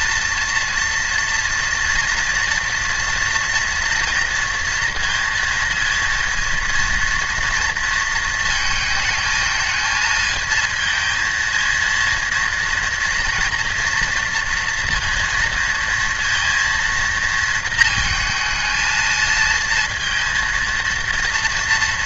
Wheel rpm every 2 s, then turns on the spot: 230, 230, 230, 230, 220, 220, 230, 230, 230, 220, 230.
none